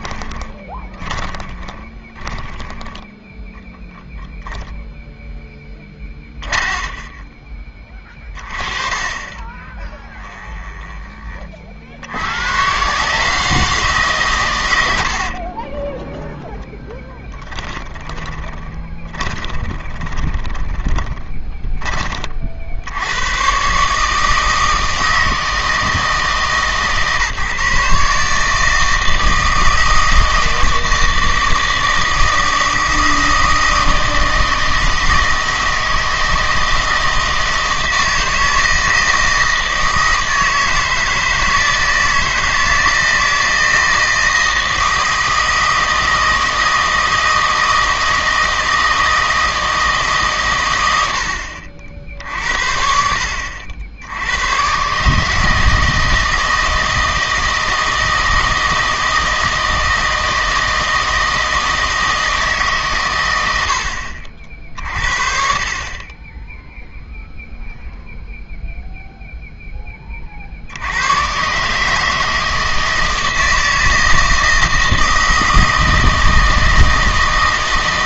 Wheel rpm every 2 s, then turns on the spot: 10, 10, 0, 20, 30, 20, 140, 80, 0, 20, 10, 70, 160, 150, 160, 160, 160, 160, 160, 160, 160, 160, 160, 160, 160, 110, 70, 130, 160, 160, 160, 140, 50, 0, 0, 70, 160, 160, 160.
0-2 10-12 18-22